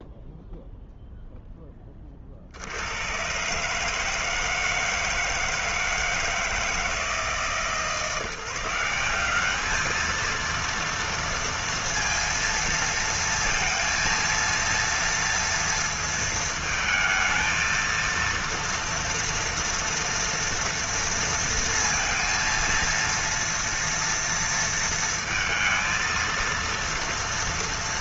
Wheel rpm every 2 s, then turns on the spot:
0, 70, 160, 160, 170, 230, 230, 230, 220, 230, 230, 230, 230, 230.
none